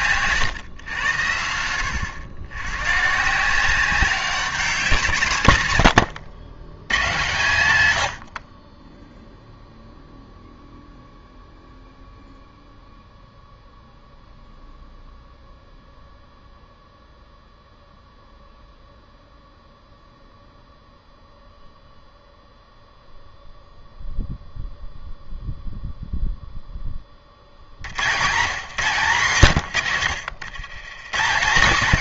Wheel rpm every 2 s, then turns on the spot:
120, 100, 180, 120, 40, 0, 0, 0, 0, 0, 0, 0, 0, 0, 160, 120.
none